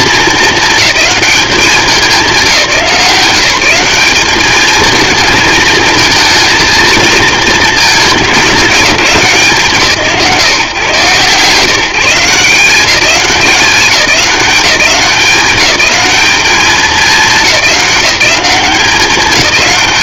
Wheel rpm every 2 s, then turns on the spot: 220, 180, 220, 230, 200, 140, 180, 190, 200, 200.
none